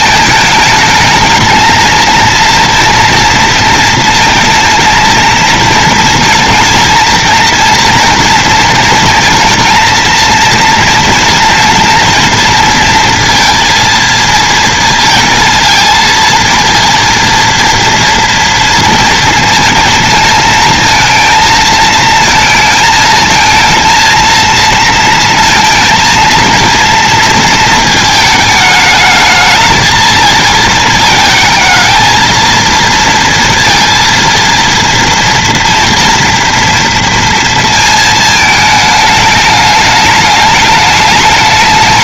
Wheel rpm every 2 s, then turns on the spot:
220, 230, 230, 230, 230, 230, 230, 230, 220, 230, 220, 220, 230, 230, 220, 220, 230, 230, 230, 220, 210.
none